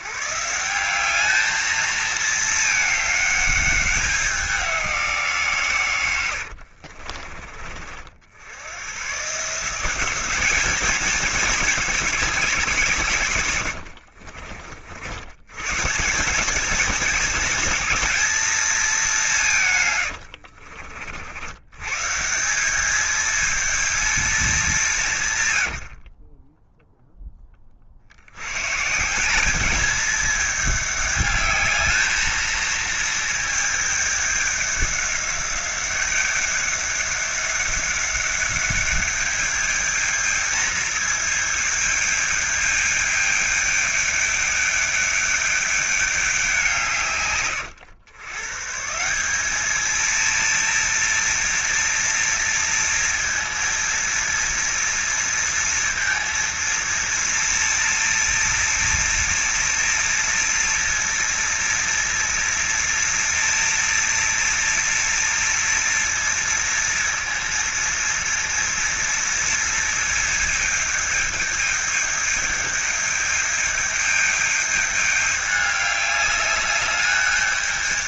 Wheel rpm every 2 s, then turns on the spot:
170, 210, 180, 60, 110, 220, 160, 60, 210, 210, 50, 200, 190, 10, 150, 210, 220, 200, 200, 200, 220, 210, 200, 160, 150, 230, 230, 230, 230, 230, 230, 230, 230, 230, 230, 210, 210, 210, 210.
6-8